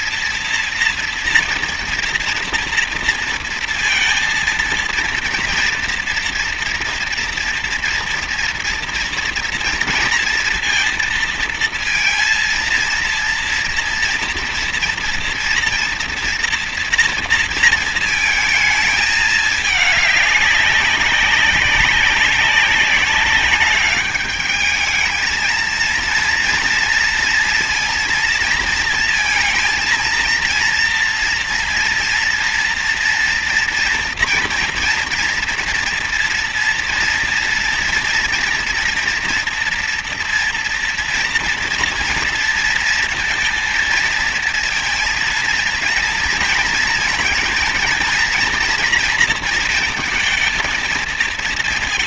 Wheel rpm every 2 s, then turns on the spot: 230, 230, 230, 240, 230, 230, 230, 230, 230, 220, 200, 190, 210, 230, 230, 230, 240, 240, 230, 230, 230, 230, 230, 230, 230, 230.
none